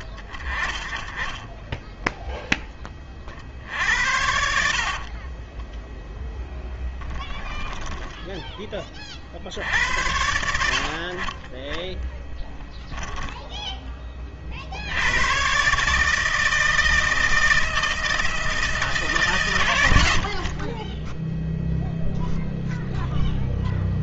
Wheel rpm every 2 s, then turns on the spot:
30, 10, 60, 10, 10, 70, 10, 40, 150, 160, 70, 0.
4-6 8-10 12-14